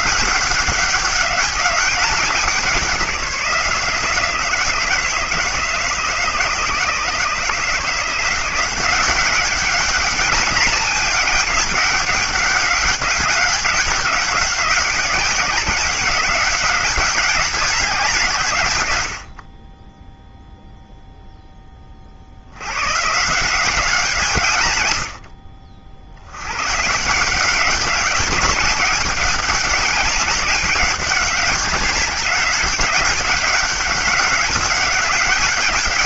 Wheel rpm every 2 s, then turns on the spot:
190, 180, 160, 150, 180, 200, 200, 190, 190, 120, 0, 100, 130, 140, 200, 200, 200, 200.
none